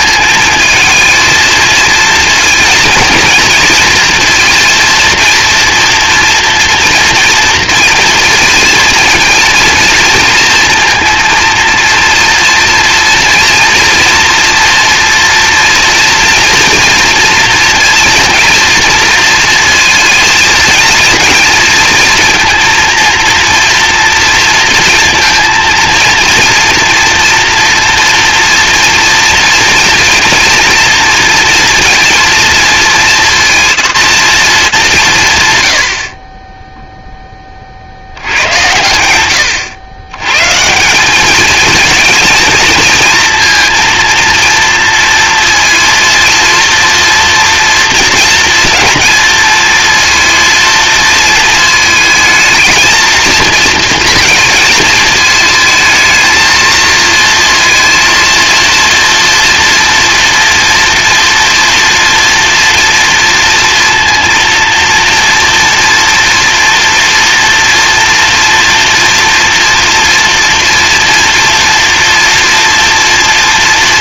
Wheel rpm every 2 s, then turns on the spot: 220, 230, 230, 230, 230, 230, 230, 230, 230, 230, 230, 230, 230, 230, 230, 230, 230, 180, 0, 90, 170, 230, 230, 230, 220, 230, 230, 220, 230, 230, 230, 230, 230, 230, 230, 230, 230.
none